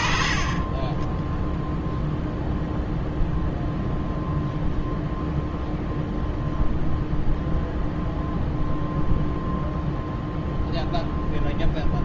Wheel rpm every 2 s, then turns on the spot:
20, 0, 0, 0, 0, 0.
none